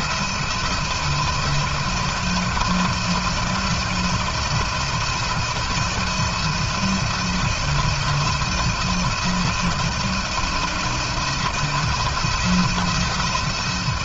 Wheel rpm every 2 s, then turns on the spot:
170, 160, 160, 170, 170, 170, 170.
none